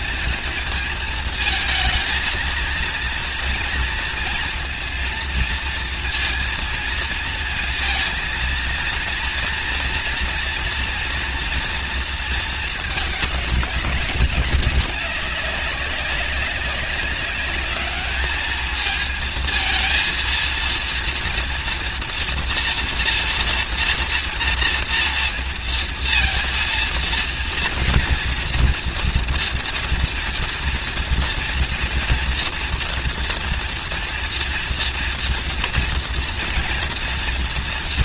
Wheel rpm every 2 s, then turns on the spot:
220, 230, 230, 220, 230, 230, 210, 200, 200, 220, 230, 240, 230, 230, 240, 230, 230, 230, 230.
none